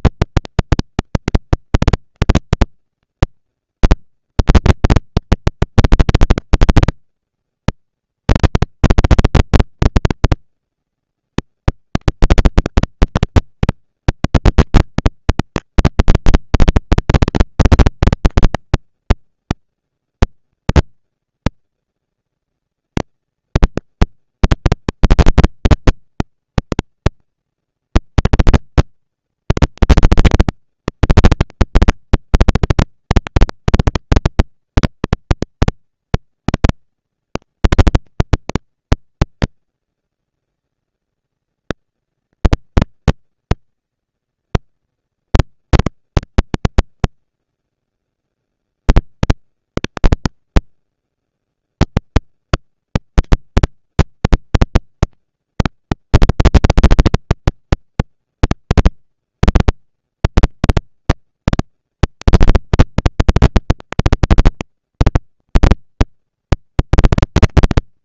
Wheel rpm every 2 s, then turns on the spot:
230, 230, 230, 230, 230, 230, 230, 210, 200, 210, 230, 230, 230, 230, 230, 230, 230, 230, 230, 230, 230, 230, 230, 230, 200, 200, 220, 230, 230, 240, 230, 220, 230, 230.
none